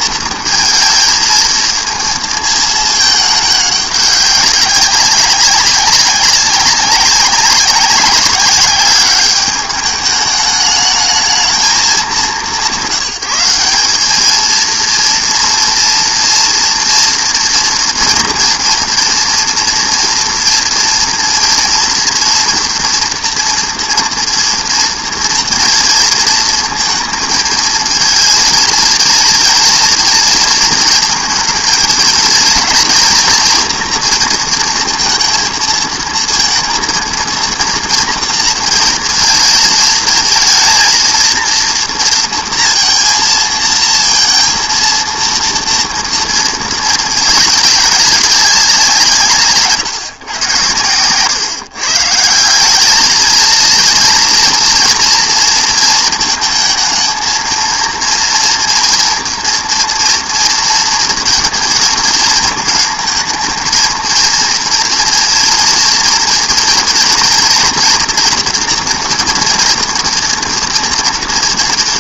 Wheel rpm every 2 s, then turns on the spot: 220, 220, 200, 190, 200, 210, 180, 230, 230, 230, 230, 230, 240, 230, 230, 230, 240, 220, 230, 230, 230, 230, 230, 230, 190, 120, 180, 230, 220, 230, 230, 220, 230, 240, 230, 230.
none